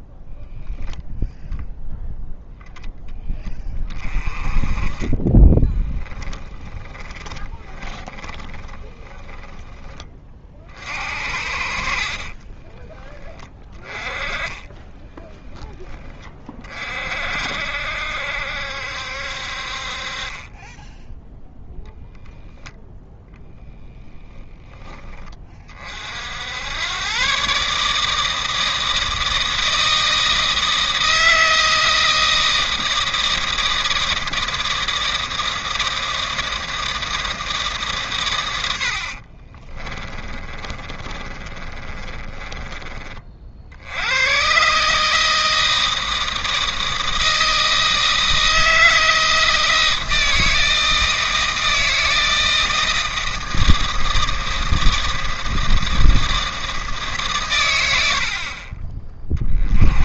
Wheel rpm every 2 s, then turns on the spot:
0, 10, 20, 30, 20, 50, 20, 10, 40, 70, 10, 0, 20, 110, 160, 160, 160, 160, 160, 80, 30, 30, 140, 160, 160, 160, 160, 160, 150, 30.
6-10 12-16 24-26 38-42